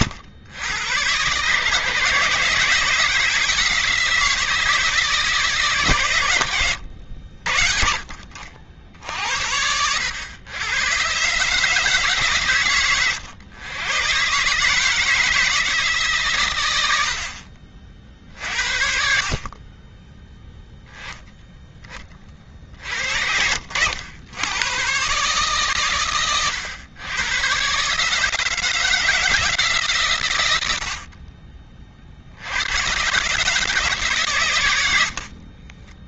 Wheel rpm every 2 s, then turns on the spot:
110, 160, 160, 90, 60, 120, 130, 150, 100, 50, 10, 60, 120, 110, 160, 80, 100, 110.
none